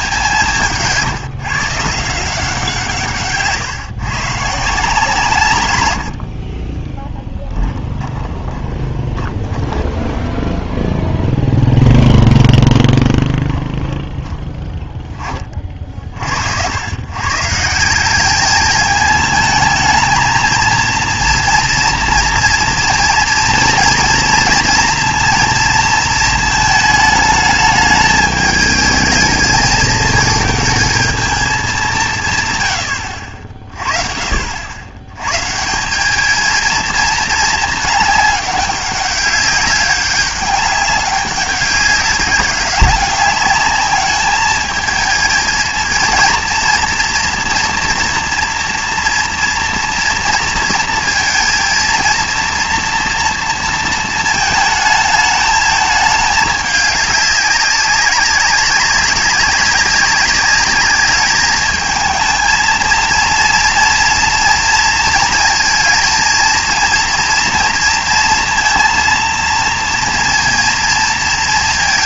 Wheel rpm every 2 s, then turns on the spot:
160, 170, 150, 20, 20, 10, 0, 10, 100, 210, 230, 230, 240, 220, 210, 220, 120, 70, 220, 200, 200, 200, 210, 230, 230, 230, 230, 220, 210, 200, 210, 230, 230, 230, 230, 230.
6-12